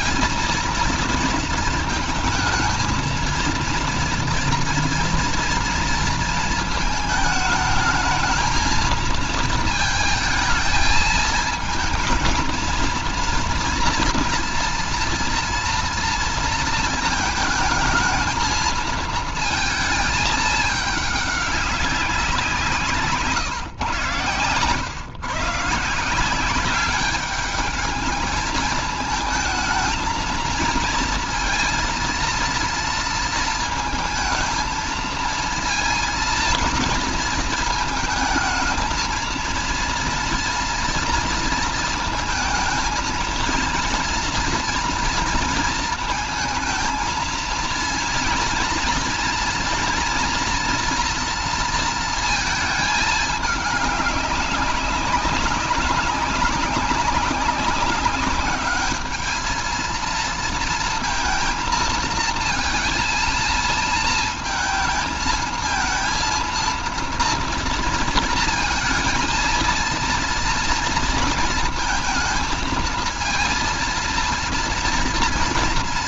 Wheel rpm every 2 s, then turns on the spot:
230, 220, 230, 220, 230, 220, 230, 230, 220, 220, 210, 160, 120, 200, 220, 220, 230, 220, 230, 230, 230, 220, 230, 230, 230, 230, 220, 190, 190, 210, 230, 230, 220, 230, 220, 230, 220, 230.
none